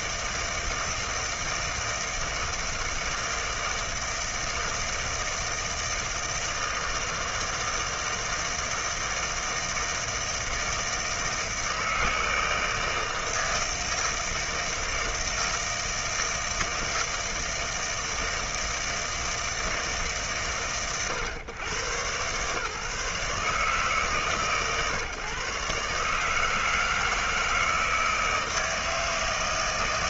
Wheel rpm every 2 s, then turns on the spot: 160, 160, 160, 160, 160, 160, 160, 160, 160, 160, 120, 130, 140, 160, 160.
none